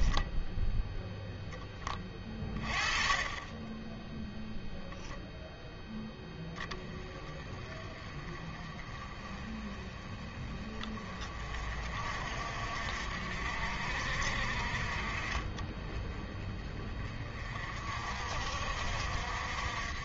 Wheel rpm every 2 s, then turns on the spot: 10, 30, 0, 20, 30, 30, 50, 50, 30, 60.
none